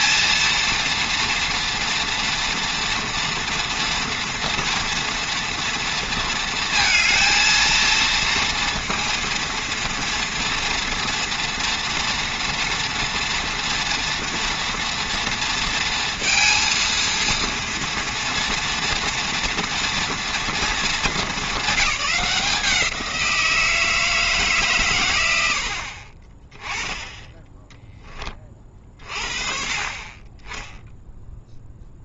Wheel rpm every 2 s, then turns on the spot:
230, 230, 230, 220, 230, 240, 230, 230, 230, 240, 220, 180, 120, 10, 40, 0.
none